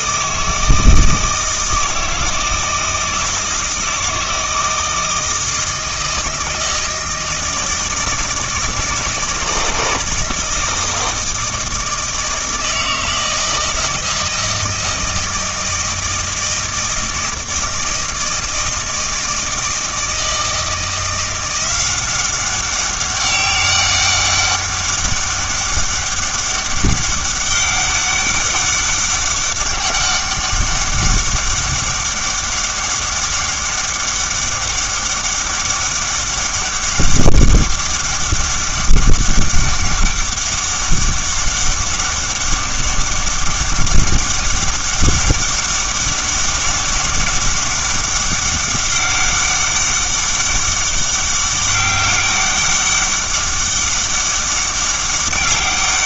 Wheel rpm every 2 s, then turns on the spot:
160, 160, 160, 160, 160, 160, 160, 160, 160, 160, 170, 190, 200, 200, 200, 200, 200, 200, 200, 200, 200, 200, 200, 200, 200, 200, 200, 200.
none